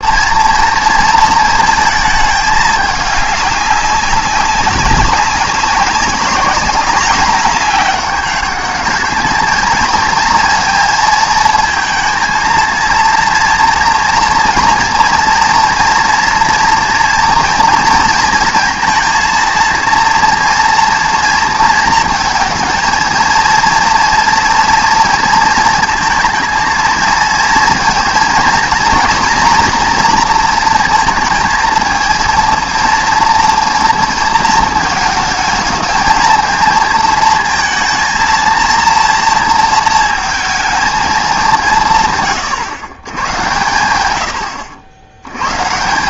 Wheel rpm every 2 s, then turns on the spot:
230, 210, 200, 200, 210, 230, 230, 230, 230, 230, 230, 230, 230, 230, 230, 230, 230, 220, 220, 230, 220, 130, 80.
none